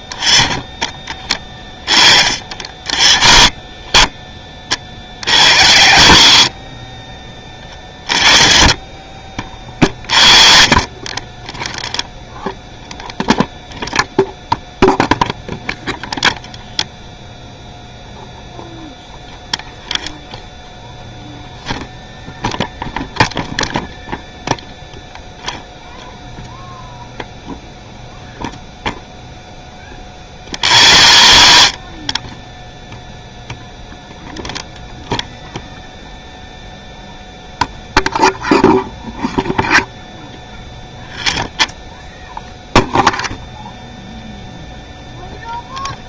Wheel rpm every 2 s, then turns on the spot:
20, 40, 40, 50, 40, 40, 0, 0, 0, 0, 0, 0, 0, 0, 0, 60, 0, 0, 0, 0, 0, 0, 0.
6-8